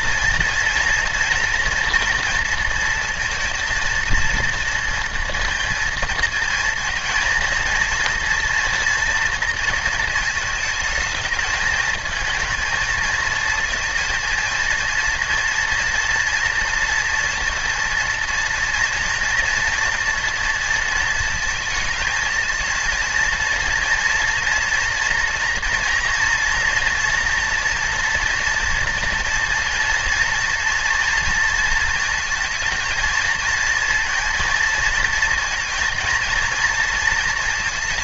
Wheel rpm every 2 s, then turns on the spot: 230, 230, 230, 230, 230, 220, 230, 230, 230, 230, 230, 230, 230, 230, 230, 230, 220, 230, 230.
none